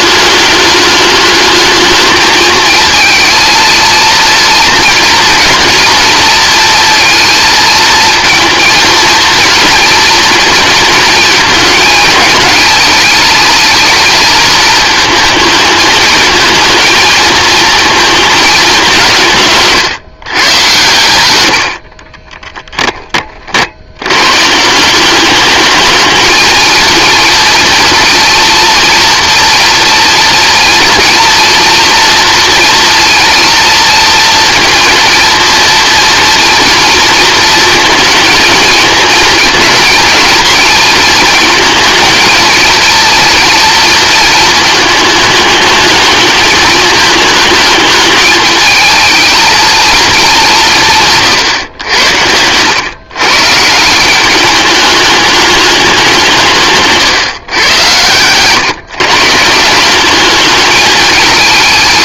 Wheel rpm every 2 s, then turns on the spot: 210, 220, 230, 230, 230, 220, 210, 220, 230, 190, 120, 10, 160, 220, 230, 230, 230, 230, 240, 230, 230, 230, 220, 210, 220, 170, 110, 200, 160, 130, 210.
none